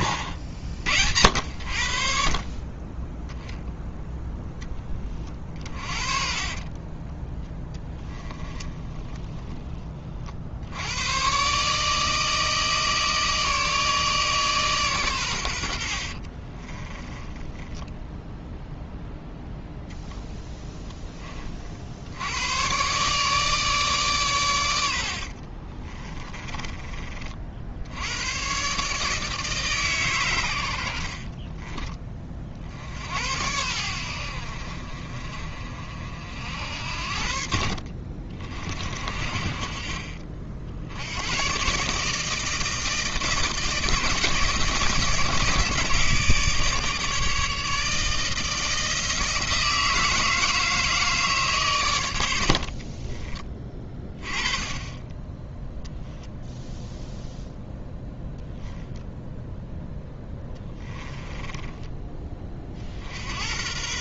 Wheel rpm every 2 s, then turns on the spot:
60, 20, 20, 30, 20, 90, 160, 130, 20, 0, 10, 130, 80, 30, 140, 70, 60, 50, 70, 50, 80, 160, 160, 150, 160, 160, 50, 20, 10, 0, 10, 50.
6-10 16-18 24-26 52-54 56-58 60-62